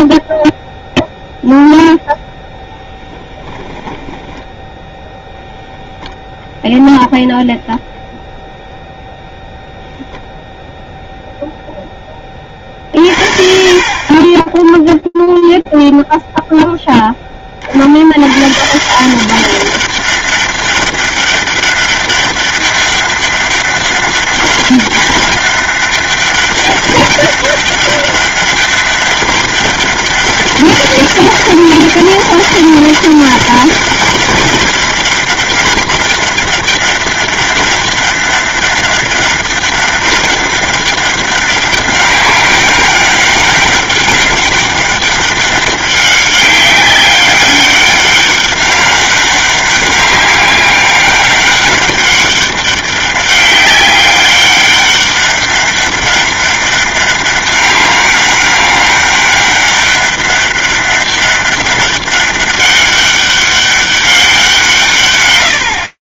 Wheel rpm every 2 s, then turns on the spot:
0, 10, 10, 0, 0, 0, 30, 10, 10, 170, 200, 200, 200, 200, 200, 200, 200, 200, 200, 200, 200, 200, 200, 200, 200, 200, 200, 200, 200, 200, 200, 200, 150.
4-6